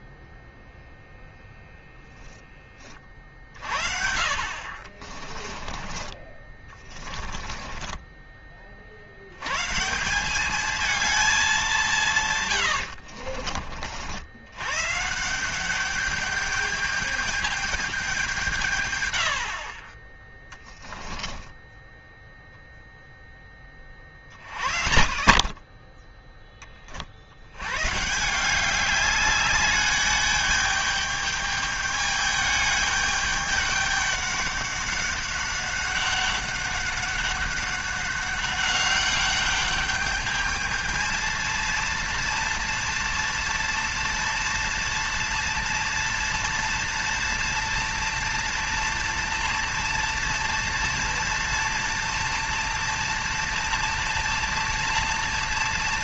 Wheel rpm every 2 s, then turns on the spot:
0, 20, 50, 20, 30, 200, 110, 100, 210, 170, 10, 0, 40, 20, 170, 210, 210, 200, 200, 200, 210, 230, 230, 230, 230, 230, 230, 230.
4-8 12-14 20-22